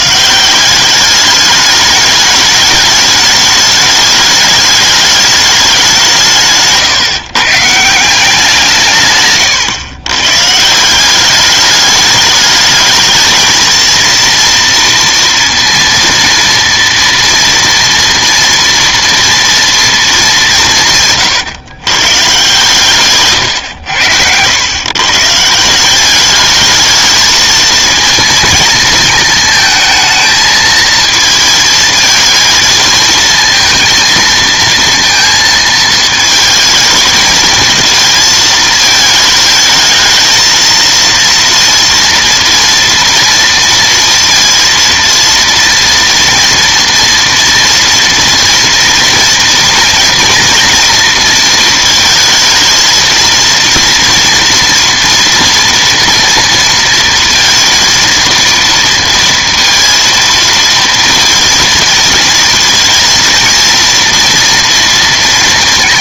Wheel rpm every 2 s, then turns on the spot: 190, 220, 210, 140, 160, 160, 210, 230, 230, 230, 160, 130, 110, 210, 230, 220, 220, 230, 220, 220, 230, 230, 230, 230, 230, 230, 220, 230, 230, 230, 230, 230, 230.
6-8